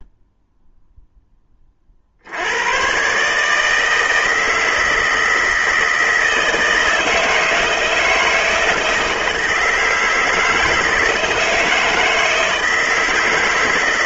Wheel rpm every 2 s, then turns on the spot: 0, 110, 160, 160, 160, 160, 160.
none